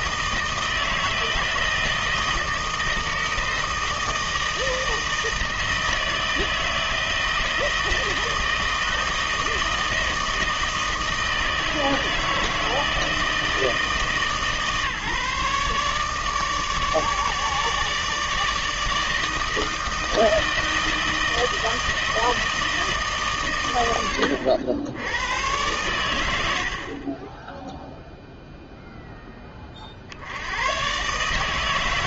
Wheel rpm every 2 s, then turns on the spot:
160, 160, 160, 160, 160, 160, 160, 150, 150, 160, 160, 160, 90, 80, 0, 100.
none